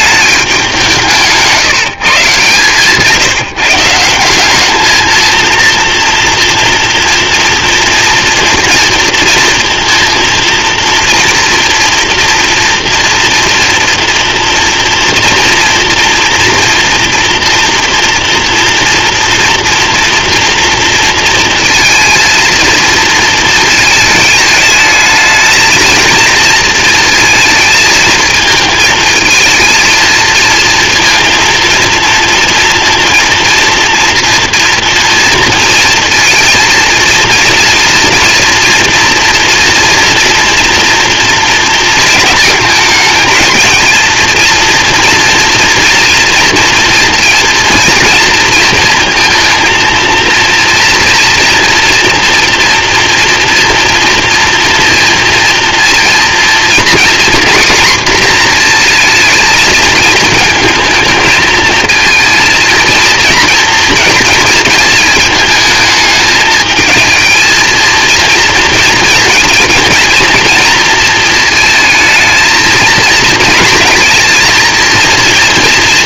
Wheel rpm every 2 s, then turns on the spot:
170, 170, 220, 230, 230, 230, 230, 230, 240, 240, 230, 230, 220, 220, 230, 230, 230, 230, 230, 240, 230, 220, 230, 230, 230, 230, 240, 230, 240, 230, 220, 230, 220, 220, 230, 230, 230, 230.
none